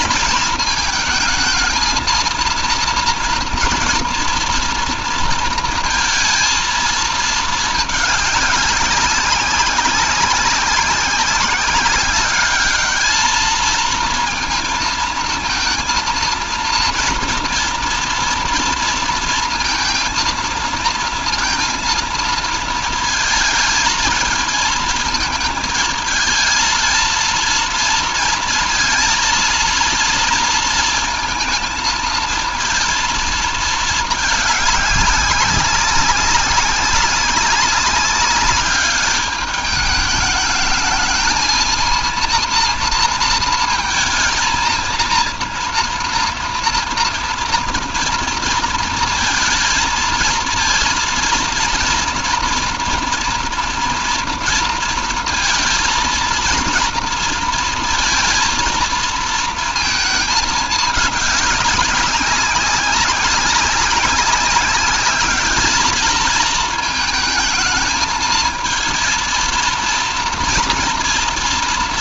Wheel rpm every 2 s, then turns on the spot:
220, 230, 230, 220, 190, 190, 210, 230, 230, 230, 220, 220, 220, 230, 230, 230, 230, 200, 190, 200, 220, 230, 230, 230, 230, 230, 240, 230, 230, 230, 210, 190, 200, 220, 230, 230.
none